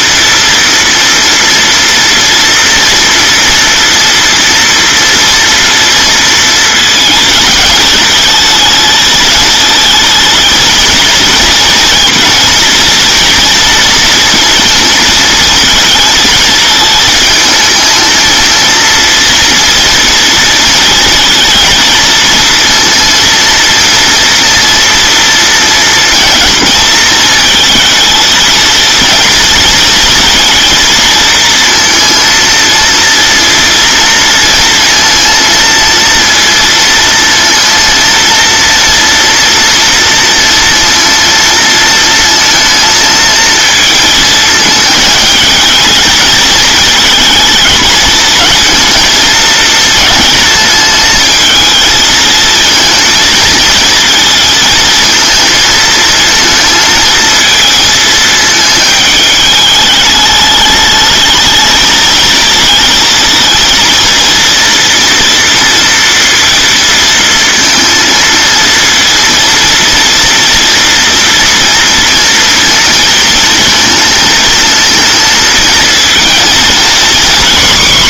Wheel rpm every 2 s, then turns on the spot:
230, 230, 230, 230, 220, 230, 230, 230, 220, 230, 230, 230, 240, 230, 230, 230, 230, 230, 230, 230, 230, 220, 220, 230, 220, 220, 230, 220, 220, 220, 210, 230, 230, 230, 230, 230, 230, 220, 230.
none